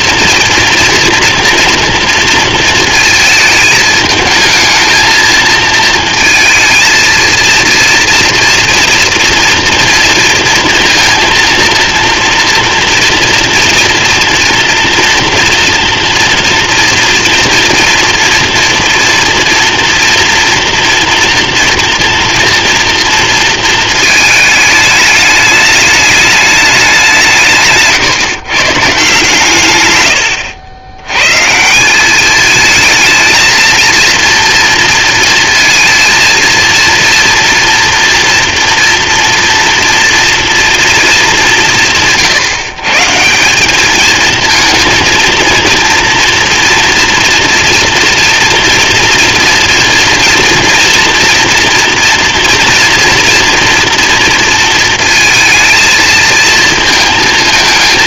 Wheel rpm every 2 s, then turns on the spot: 230, 220, 220, 230, 230, 230, 230, 230, 240, 240, 230, 230, 210, 180, 150, 120, 220, 230, 230, 230, 210, 170, 230, 230, 230, 230, 230, 230, 220.
none